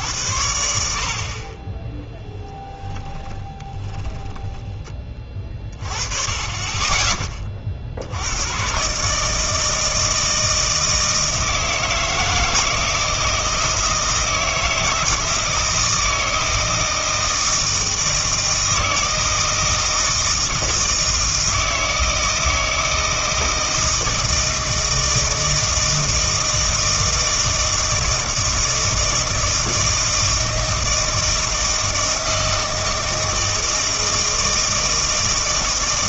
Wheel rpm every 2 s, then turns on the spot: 80, 10, 10, 20, 110, 160, 160, 160, 160, 160, 160, 160, 160, 160, 160, 160, 160, 160.
2-4